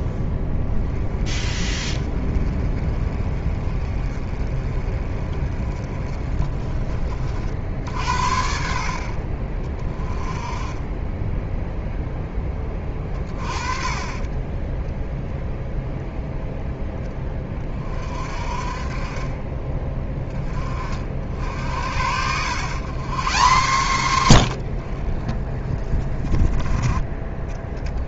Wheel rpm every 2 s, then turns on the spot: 20, 30, 30, 30, 60, 20, 30, 10, 10, 40, 40, 130, 60, 20.
none